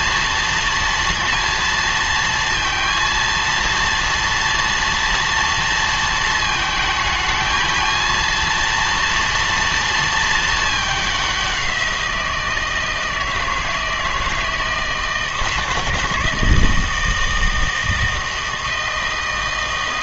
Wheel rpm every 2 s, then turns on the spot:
230, 230, 230, 220, 230, 210, 160, 160, 160, 160.
none